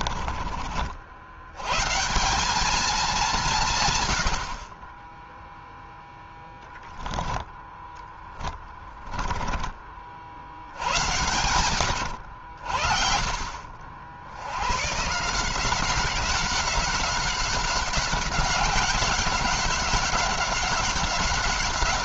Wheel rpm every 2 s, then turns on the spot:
60, 210, 30, 10, 10, 90, 50, 130, 190, 190, 190.
8-10